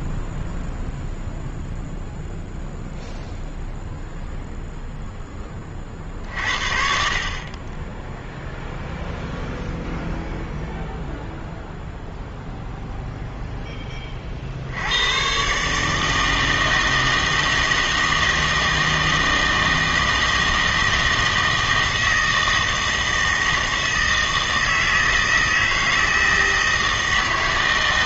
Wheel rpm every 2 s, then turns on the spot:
0, 0, 0, 50, 0, 0, 0, 60, 160, 160, 160, 160, 160, 160.
none